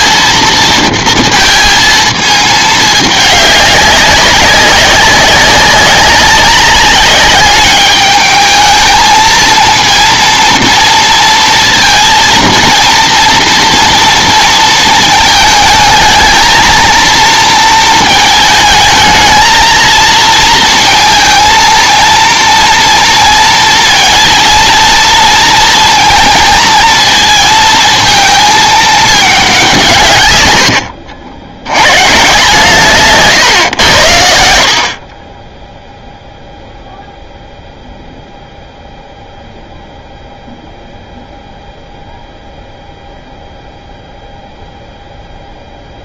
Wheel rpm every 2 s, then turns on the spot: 230, 210, 190, 200, 220, 230, 230, 230, 230, 220, 230, 230, 230, 230, 220, 90, 150, 60, 0, 0, 0, 0, 0.
none